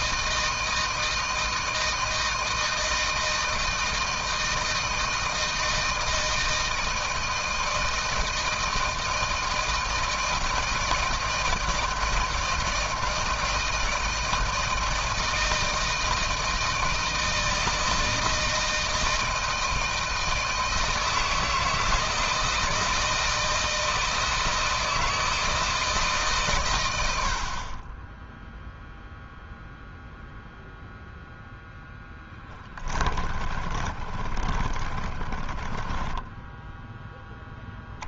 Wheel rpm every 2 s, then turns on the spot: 160, 160, 160, 160, 160, 160, 160, 160, 160, 160, 160, 160, 160, 100, 0, 0, 20, 30, 10.
32-36